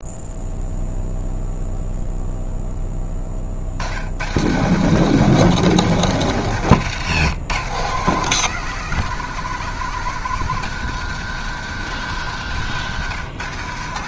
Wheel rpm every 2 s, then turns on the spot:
0, 10, 150, 140, 160, 150, 120.
none